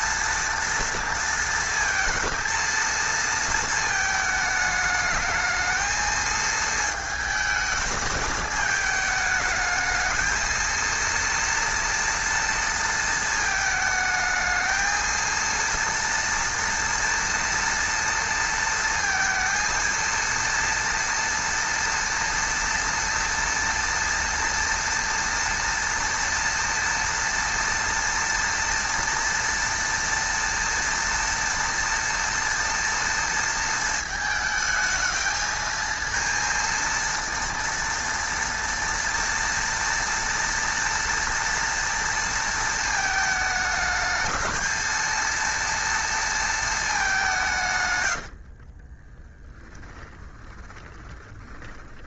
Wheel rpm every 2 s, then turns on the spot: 230, 230, 220, 220, 220, 230, 230, 220, 230, 230, 230, 230, 230, 230, 230, 240, 230, 220, 230, 230, 230, 220, 220, 210, 30, 20.
48-52